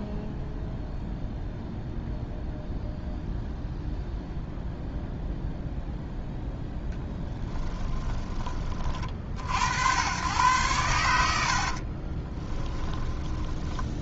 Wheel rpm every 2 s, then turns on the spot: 0, 0, 0, 0, 40, 110, 10.
12-14